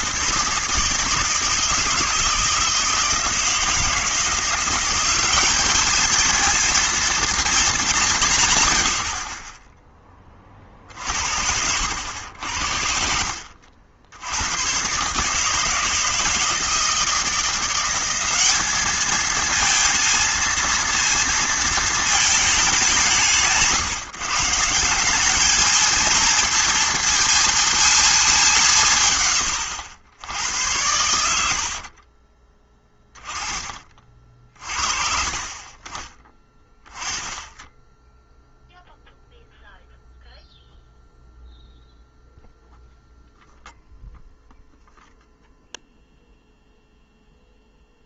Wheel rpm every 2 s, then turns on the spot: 160, 160, 180, 230, 120, 40, 70, 120, 160, 210, 230, 190, 170, 230, 170, 90, 10, 40, 20, 0, 0, 0, 0, 0.
10-14